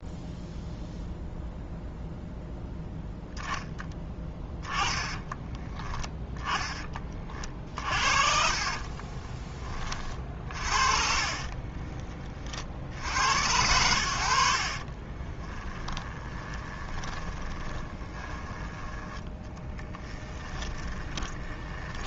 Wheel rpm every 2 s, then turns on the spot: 0, 0, 10, 30, 40, 40, 70, 30, 20, 10, 20.
6-12 14-18 20-22